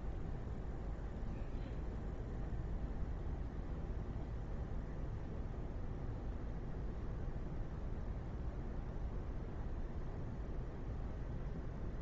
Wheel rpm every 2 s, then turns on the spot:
0, 0, 0, 0, 0, 0.
none